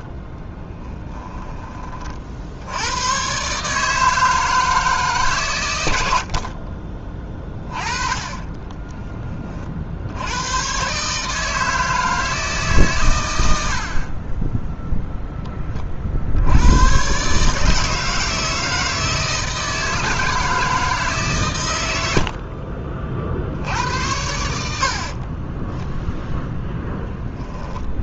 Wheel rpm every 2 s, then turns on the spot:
10, 90, 150, 30, 20, 120, 130, 0, 110, 160, 160, 40, 60, 0.
0-2 8-10